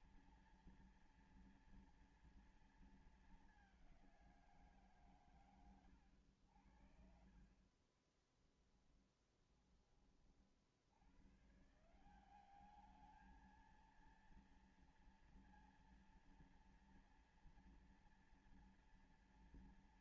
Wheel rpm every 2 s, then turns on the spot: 230, 230, 160, 70, 10, 40, 190, 230, 230, 230.
8-10